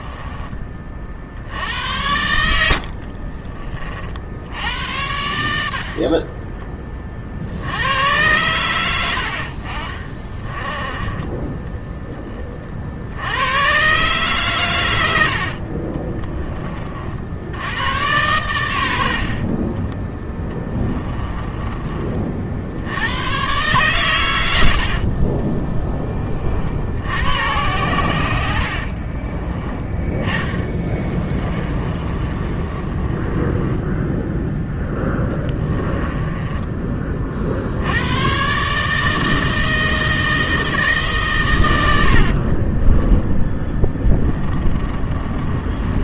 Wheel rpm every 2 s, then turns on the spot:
40, 70, 90, 30, 90, 20, 60, 100, 40, 80, 20, 80, 70, 70, 50, 20, 30, 10, 20, 150, 150, 20, 30.
2-4 20-22 28-34 42-46